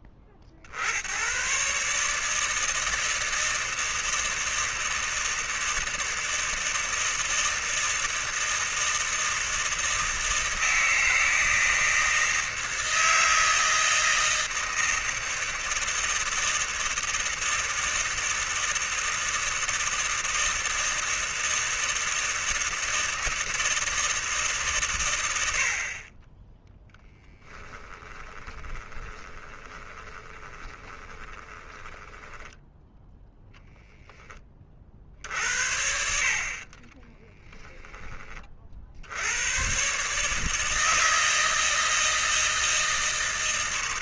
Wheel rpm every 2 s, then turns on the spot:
50, 160, 160, 160, 160, 160, 160, 160, 160, 160, 160, 160, 140, 10, 20, 20, 10, 40, 30, 50, 160, 160.
28-32 36-38